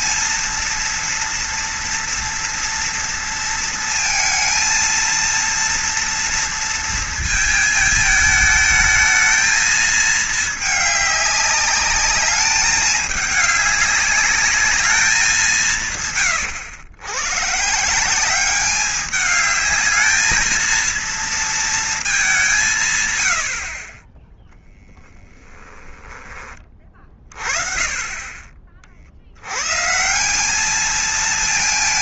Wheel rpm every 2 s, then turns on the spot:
230, 240, 230, 230, 220, 210, 210, 210, 100, 200, 220, 170, 0, 30, 40, 210.
none